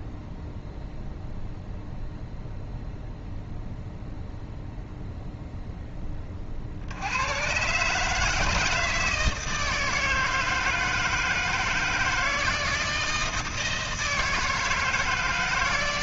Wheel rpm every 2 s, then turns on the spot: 0, 0, 0, 60, 160, 160, 160, 160.
none